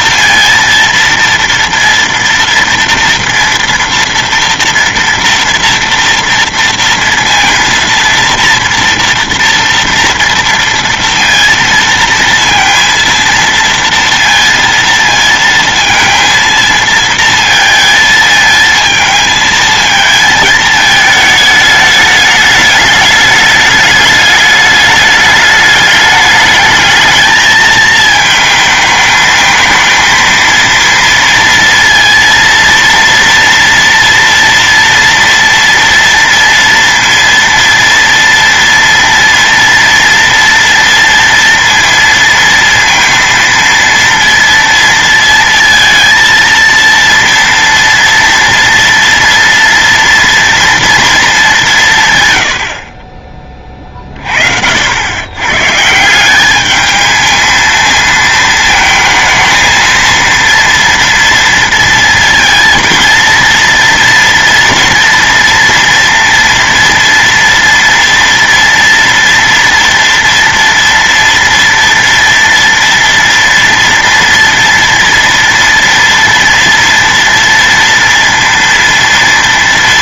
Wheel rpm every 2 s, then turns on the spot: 230, 230, 230, 230, 230, 230, 230, 230, 230, 220, 220, 210, 210, 220, 220, 230, 230, 230, 230, 230, 230, 230, 230, 230, 240, 230, 60, 70, 210, 220, 230, 230, 230, 230, 230, 230, 230, 230, 230, 230.
none